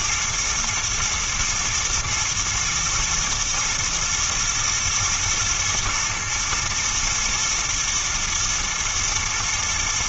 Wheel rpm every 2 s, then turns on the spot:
110, 110, 110, 110, 110.
none